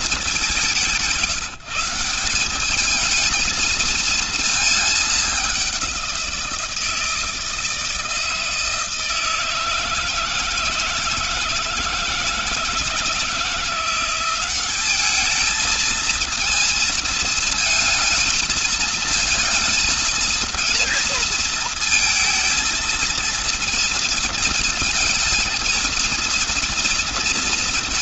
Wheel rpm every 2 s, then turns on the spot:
170, 220, 200, 160, 160, 160, 170, 210, 220, 230, 220, 230, 220, 230.
none